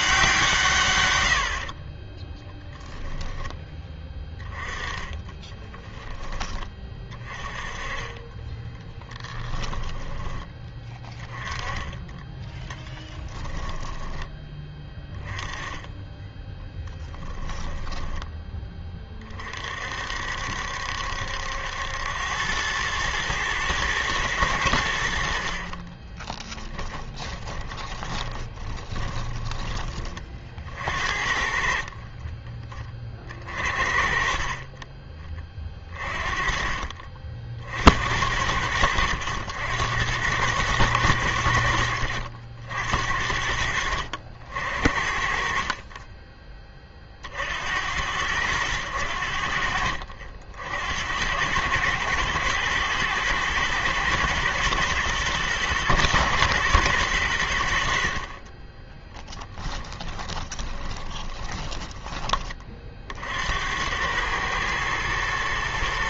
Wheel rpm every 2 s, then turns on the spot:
150, 10, 20, 20, 20, 20, 10, 20, 20, 20, 70, 100, 100, 20, 20, 50, 20, 40, 40, 80, 100, 70, 70, 20, 90, 60, 110, 120, 120, 30, 20, 30, 110.
4-6 8-10 12-14 16-18 26-30 60-62